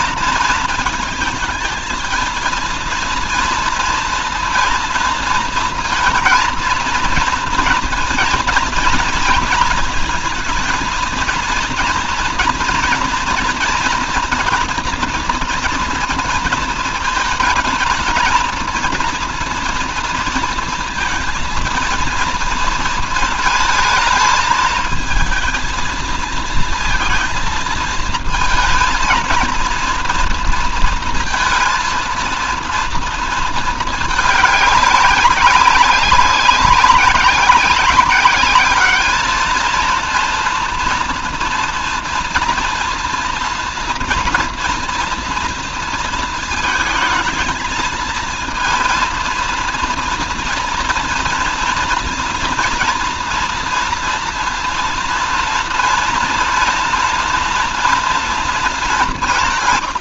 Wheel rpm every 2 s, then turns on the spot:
230, 230, 230, 230, 230, 220, 230, 230, 220, 230, 230, 220, 220, 220, 220, 230, 230, 200, 190, 200, 230, 230, 240, 220, 230, 230, 230, 230, 230, 210.
none